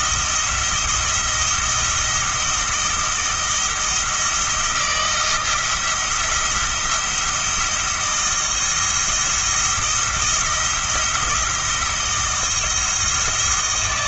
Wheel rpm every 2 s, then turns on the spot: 170, 170, 160, 170, 170, 170, 160.
none